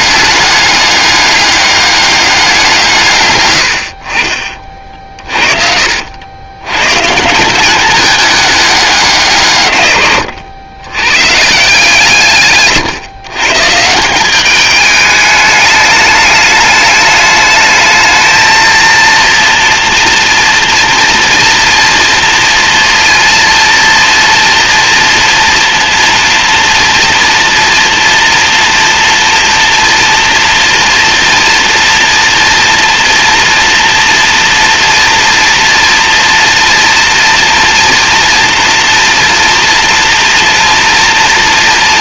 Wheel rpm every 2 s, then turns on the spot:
200, 150, 40, 130, 190, 100, 130, 210, 210, 230, 230, 230, 230, 230, 230, 240, 230, 230, 230, 230, 240.
none